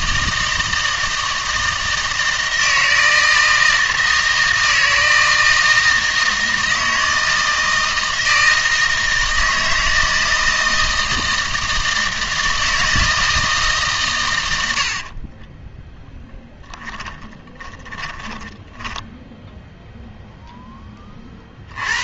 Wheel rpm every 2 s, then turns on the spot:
160, 160, 160, 160, 160, 160, 160, 80, 10, 10, 10.
16-20